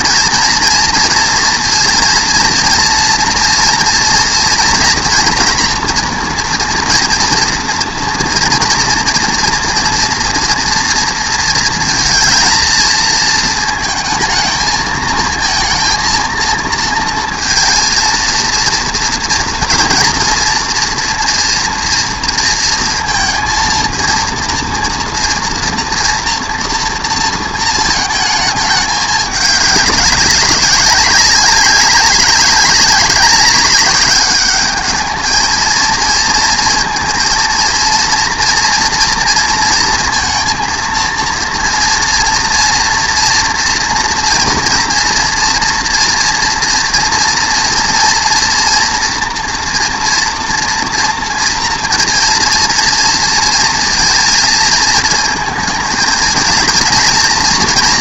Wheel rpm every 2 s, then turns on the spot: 240, 230, 230, 230, 240, 230, 230, 220, 230, 230, 230, 230, 230, 240, 220, 190, 190, 210, 230, 240, 230, 230, 230, 230, 230, 230, 230, 220, 230.
none